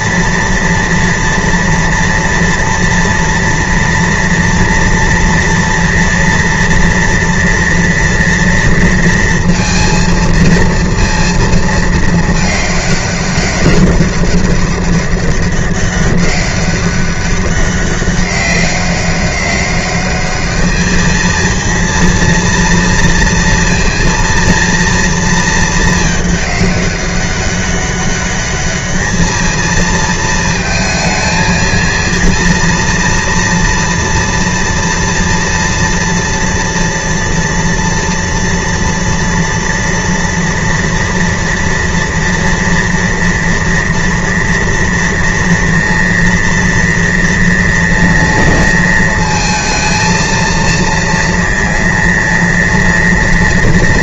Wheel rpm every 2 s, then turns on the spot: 230, 230, 230, 230, 230, 230, 210, 200, 200, 200, 210, 230, 230, 200, 210, 220, 230, 230, 230, 230, 230, 230, 230, 230, 230, 230, 230.
none